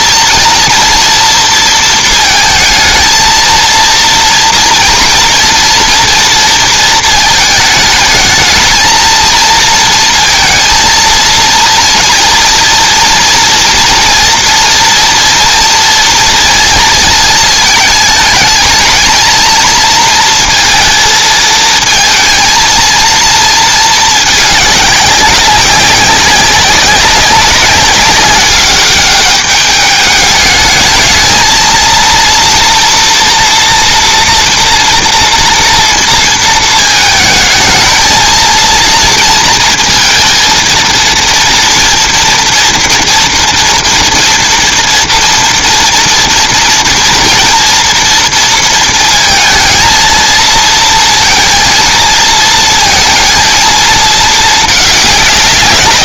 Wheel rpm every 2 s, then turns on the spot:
230, 220, 230, 230, 220, 230, 230, 230, 230, 220, 230, 230, 200, 190, 200, 220, 230, 230, 220, 230, 230, 240, 230, 230, 230, 230, 230, 210.
none